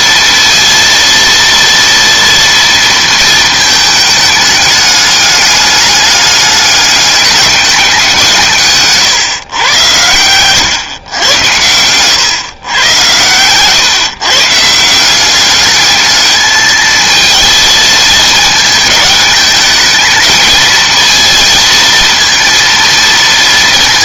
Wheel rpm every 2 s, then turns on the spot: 230, 230, 210, 200, 150, 130, 120, 160, 220, 220, 220, 230.
10-12